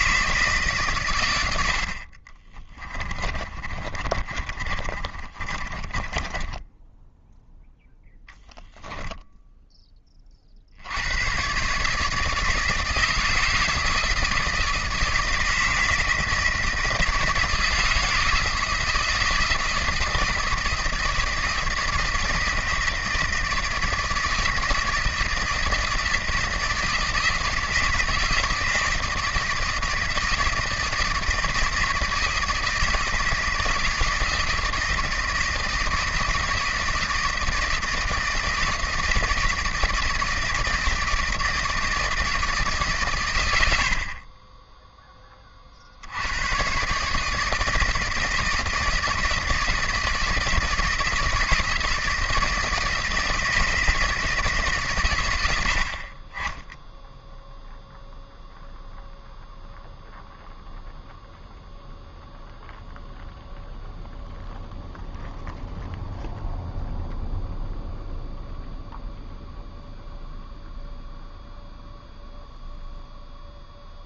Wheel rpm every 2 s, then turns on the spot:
140, 20, 30, 10, 0, 70, 160, 160, 160, 160, 160, 160, 160, 160, 160, 160, 160, 160, 160, 160, 160, 150, 10, 120, 160, 160, 160, 150, 10, 0, 0, 0, 0, 0, 0, 0, 0.
2-8